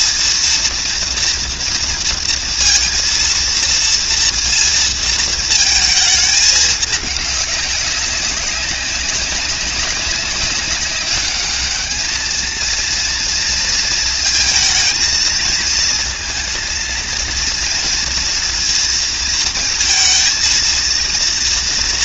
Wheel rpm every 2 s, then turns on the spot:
230, 230, 230, 210, 200, 200, 230, 230, 230, 230, 230.
none